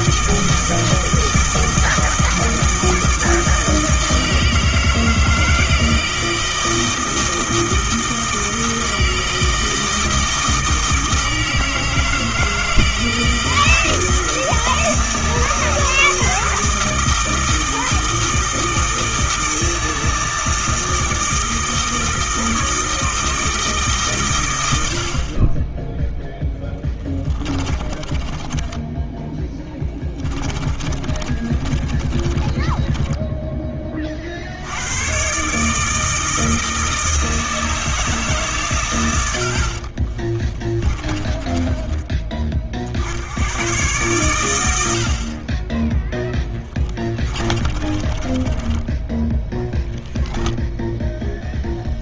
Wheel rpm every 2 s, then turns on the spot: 160, 160, 160, 160, 160, 160, 160, 160, 160, 160, 160, 160, 70, 10, 20, 30, 20, 80, 160, 110, 20, 50, 80, 20, 20, 0.
26-34 40-42 46-50